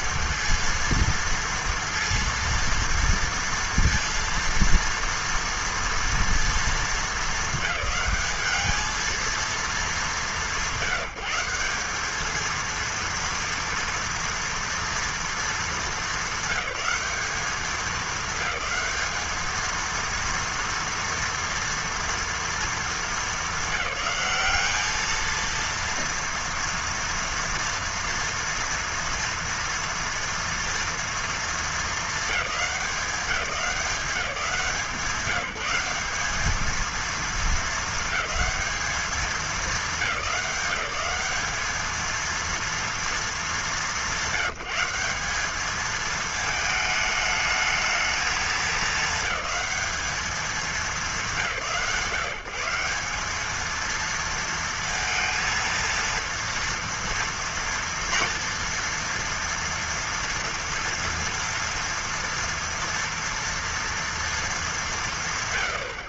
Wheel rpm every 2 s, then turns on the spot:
230, 230, 230, 220, 220, 190, 230, 230, 200, 220, 230, 230, 210, 230, 230, 230, 200, 180, 210, 220, 170, 230, 190, 220, 210, 210, 170, 230, 230, 230, 230, 230, 220.
none